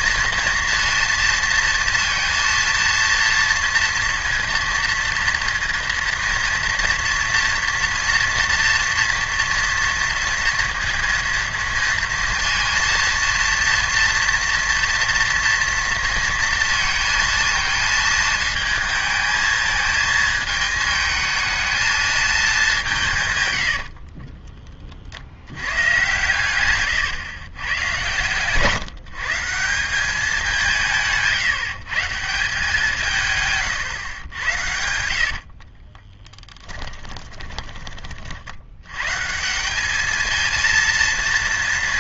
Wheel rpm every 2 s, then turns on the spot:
230, 230, 230, 230, 230, 230, 230, 230, 230, 220, 220, 200, 30, 120, 140, 170, 180, 100, 10, 70, 220.
26-28 36-38